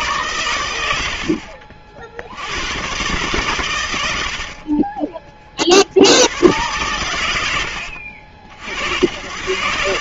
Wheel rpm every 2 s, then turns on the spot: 110, 100, 50, 100, 60.
4-6